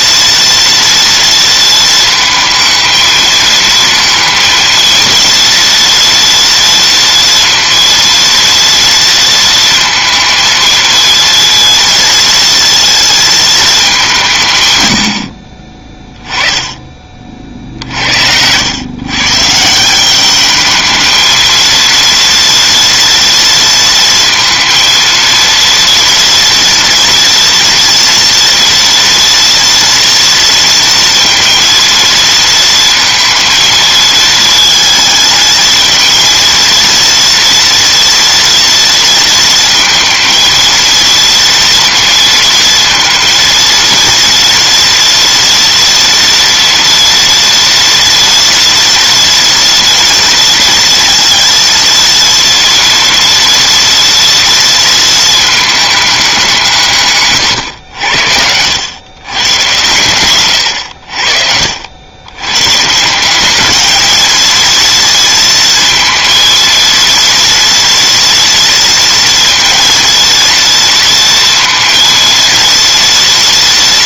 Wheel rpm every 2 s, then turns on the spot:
230, 220, 230, 230, 230, 220, 230, 90, 30, 120, 220, 230, 230, 230, 230, 230, 230, 220, 230, 230, 230, 230, 230, 230, 230, 230, 230, 230, 160, 100, 80, 150, 230, 230, 230, 230, 230.
none